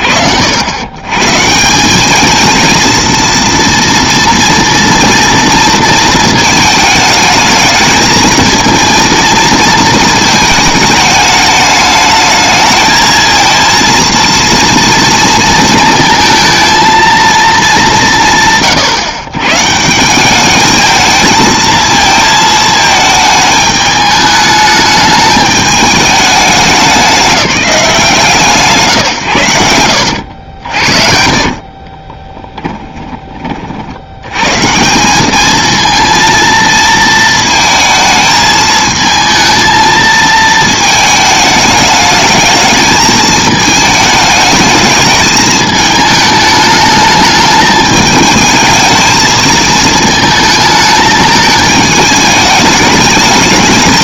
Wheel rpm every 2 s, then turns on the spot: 110, 230, 230, 220, 230, 210, 220, 230, 230, 120, 220, 220, 210, 200, 120, 50, 10, 160, 230, 220, 220, 220, 220, 210, 220, 220, 210.
30-34